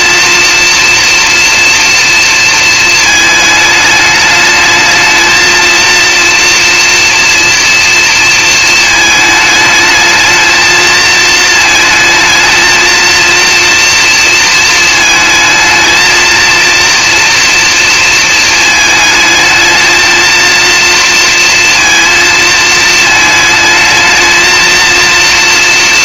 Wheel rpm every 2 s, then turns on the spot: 240, 220, 220, 240, 220, 220, 230, 220, 230, 220, 230, 220, 230.
none